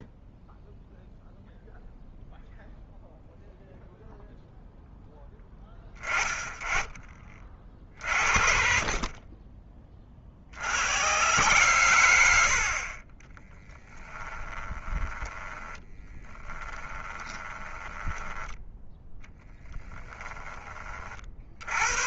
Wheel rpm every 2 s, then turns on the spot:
0, 0, 0, 20, 50, 50, 90, 20, 20, 10, 10.
14-18